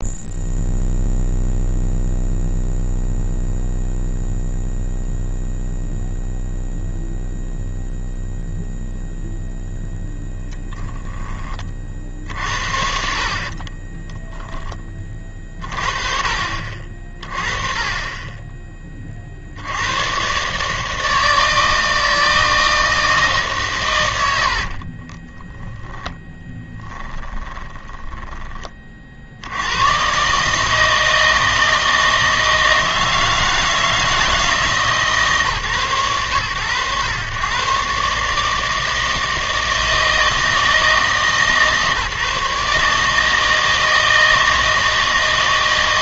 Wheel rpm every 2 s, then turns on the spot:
0, 0, 0, 0, 0, 10, 70, 20, 50, 30, 150, 160, 50, 10, 20, 150, 160, 160, 110, 160, 160, 150, 160.
24-28